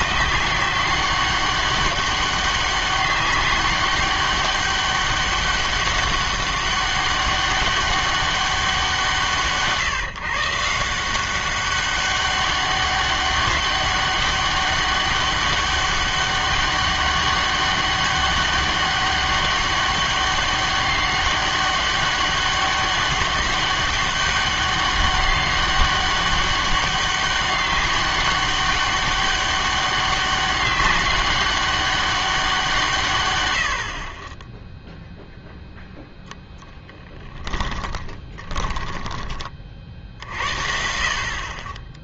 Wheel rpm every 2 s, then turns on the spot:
180, 200, 200, 200, 170, 160, 200, 200, 200, 200, 200, 200, 200, 200, 200, 200, 180, 10, 10, 20, 50.
36-40